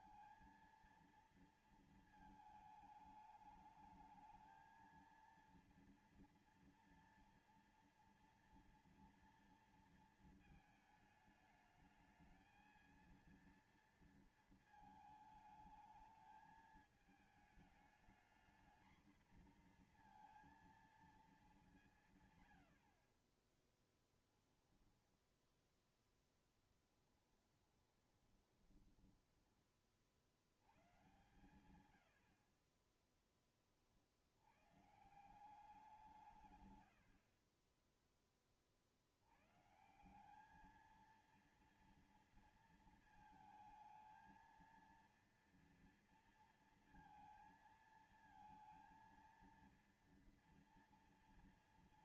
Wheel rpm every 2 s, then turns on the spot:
230, 220, 220, 230, 240, 220, 220, 230, 210, 220, 230, 140, 10, 10, 20, 50, 70, 70, 160, 30, 190, 230, 220, 230, 220, 230.
26-30